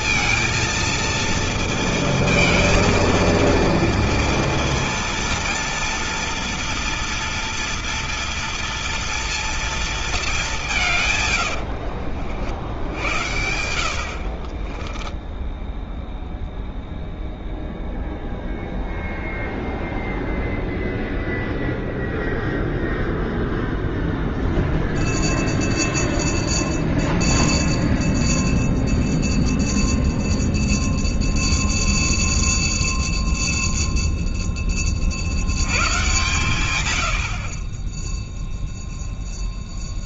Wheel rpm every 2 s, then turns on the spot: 230, 220, 230, 230, 230, 180, 60, 40, 0, 0, 0, 0, 0, 0, 0, 0, 0, 20, 110, 0.
14-16